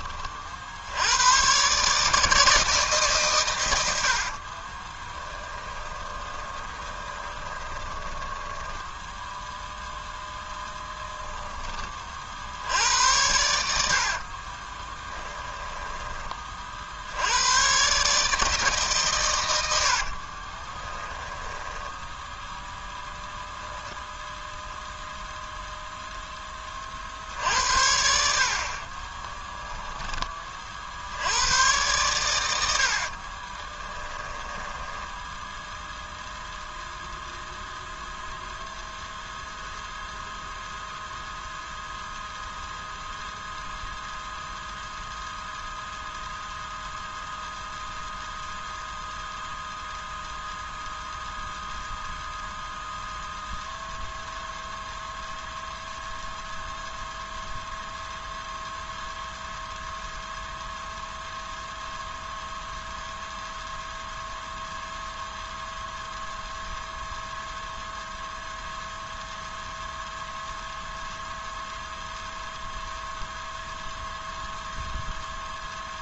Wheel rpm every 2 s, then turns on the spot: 60, 150, 30, 30, 10, 10, 80, 20, 50, 150, 20, 0, 0, 30, 40, 40, 80, 10, 0, 0, 0, 0, 0, 0, 0, 0, 0, 0, 0, 0, 0, 0, 0, 0, 0, 0, 0, 0.
4-10 14-16 20-22 34-36